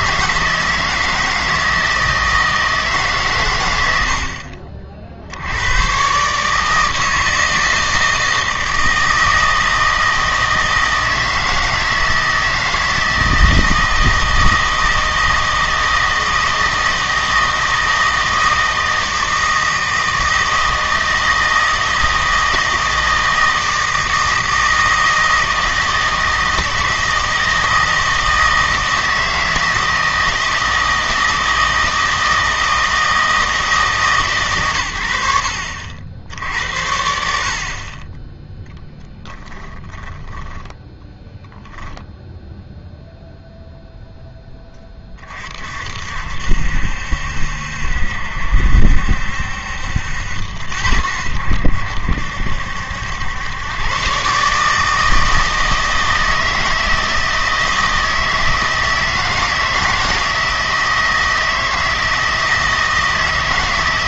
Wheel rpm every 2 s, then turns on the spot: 160, 160, 40, 160, 160, 160, 160, 160, 160, 160, 160, 160, 160, 160, 160, 160, 160, 120, 70, 0, 10, 0, 20, 70, 70, 80, 70, 150, 160, 160, 160, 160.
none